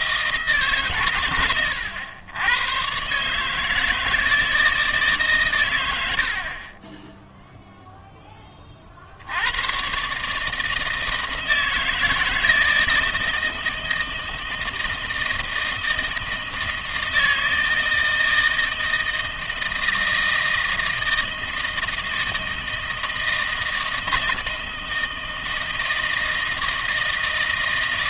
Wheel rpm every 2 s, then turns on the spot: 140, 120, 160, 20, 30, 150, 160, 160, 160, 160, 160, 160, 160, 160.
6-8